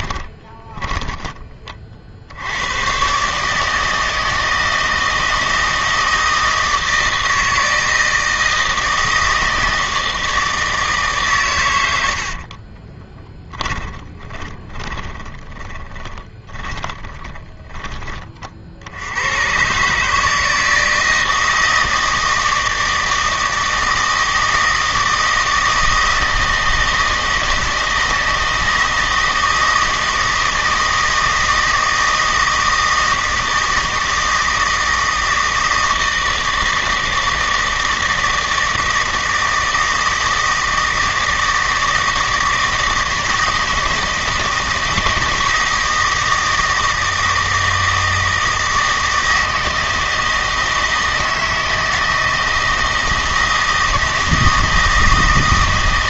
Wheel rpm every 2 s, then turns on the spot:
20, 100, 160, 160, 160, 160, 30, 20, 20, 50, 160, 160, 160, 160, 160, 160, 160, 160, 160, 160, 160, 160, 160, 160, 160, 160, 160, 160.
0-2 12-18